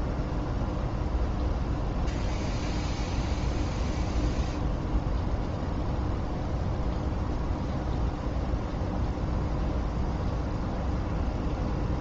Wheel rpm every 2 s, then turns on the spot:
0, 0, 0, 0, 0, 0.
none